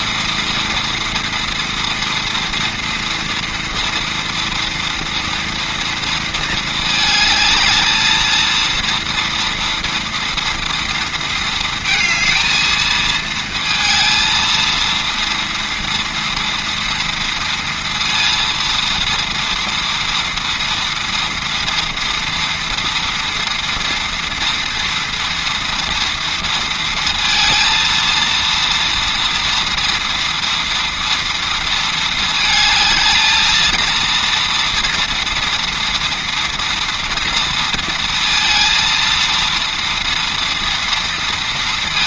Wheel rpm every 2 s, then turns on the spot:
230, 230, 230, 220, 230, 230, 230, 230, 230, 230, 230, 230, 230, 230, 230, 230, 220, 230, 230, 230, 230.
none